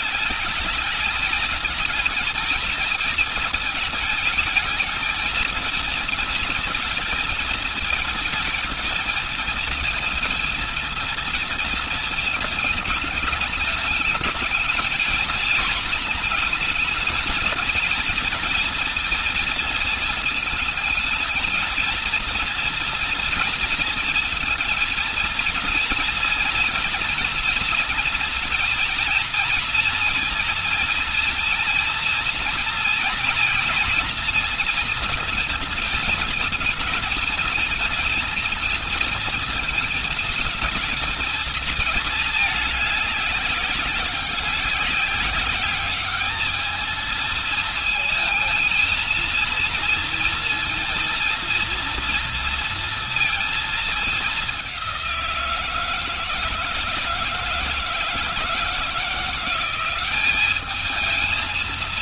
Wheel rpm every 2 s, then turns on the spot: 210, 230, 230, 230, 220, 230, 230, 220, 230, 240, 220, 230, 230, 240, 230, 220, 230, 230, 220, 220, 230, 220, 190, 220, 220, 230, 230, 200, 160, 160, 200.
none